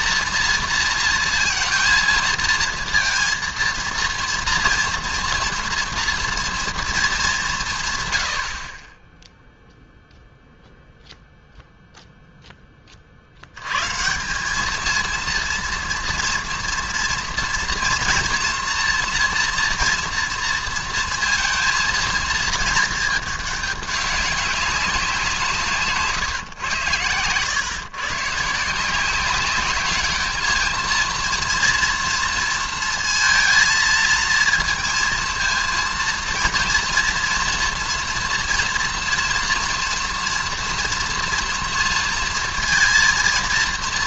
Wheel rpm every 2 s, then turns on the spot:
230, 230, 230, 230, 50, 0, 10, 200, 230, 230, 230, 220, 200, 120, 160, 220, 230, 220, 230, 230, 230, 230.
none